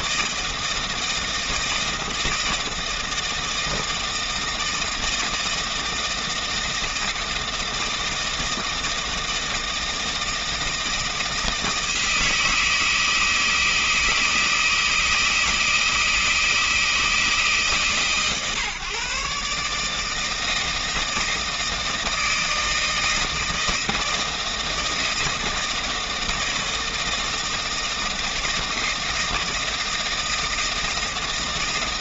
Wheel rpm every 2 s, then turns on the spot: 160, 160, 160, 160, 160, 160, 160, 160, 160, 140, 160, 160, 160, 160, 160, 160.
none